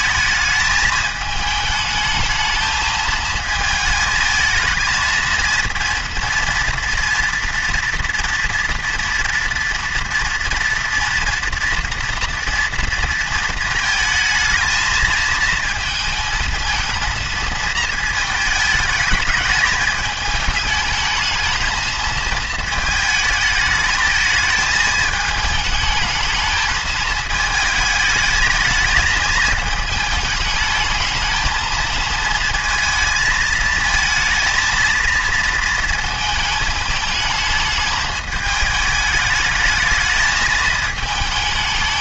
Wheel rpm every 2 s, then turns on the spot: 220, 220, 220, 230, 230, 230, 230, 220, 220, 220, 210, 220, 220, 220, 220, 210, 220, 230, 220, 220, 220.
none